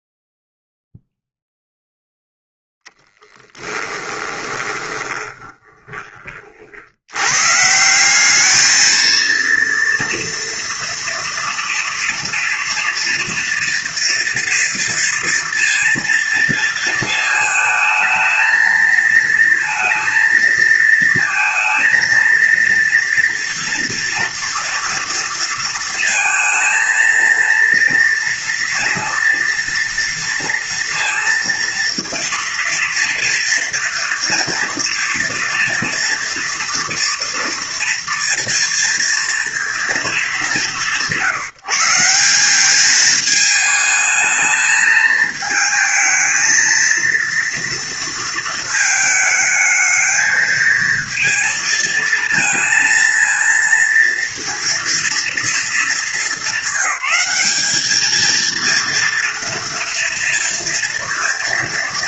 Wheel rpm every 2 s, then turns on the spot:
0, 0, 20, 40, 210, 230, 230, 230, 230, 230, 230, 230, 230, 230, 230, 230, 230, 230, 230, 230, 200, 190, 220, 220, 230, 220, 230, 230, 200, 220, 230.
4-6